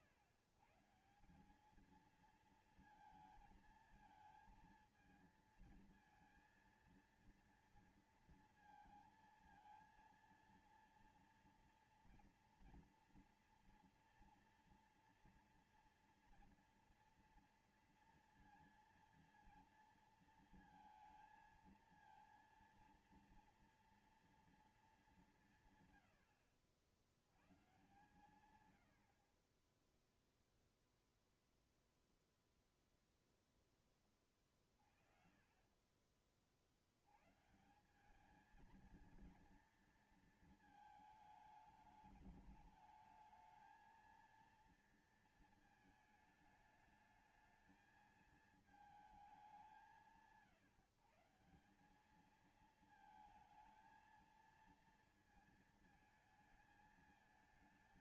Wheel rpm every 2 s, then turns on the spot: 120, 230, 220, 230, 230, 230, 230, 230, 230, 230, 230, 230, 220, 70, 100, 0, 0, 20, 50, 210, 220, 210, 230, 220, 220, 150, 210, 230, 220.
28-30